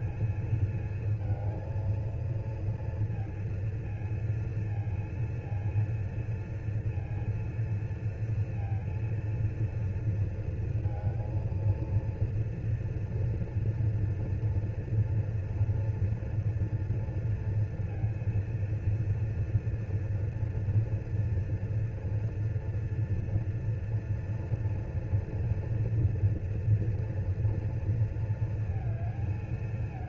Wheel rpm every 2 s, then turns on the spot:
220, 230, 230, 230, 230, 230, 230, 230, 230, 230, 230, 230, 240, 240, 230.
none